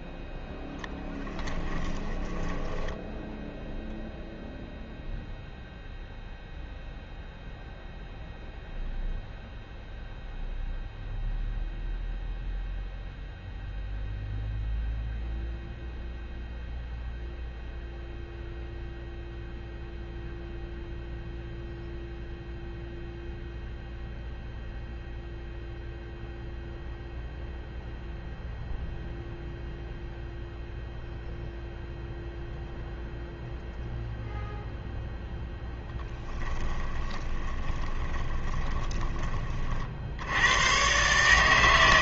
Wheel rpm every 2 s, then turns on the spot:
0, 10, 0, 0, 0, 0, 0, 0, 0, 0, 0, 0, 0, 0, 0, 0, 0, 0, 20, 20, 120.
2-4 36-40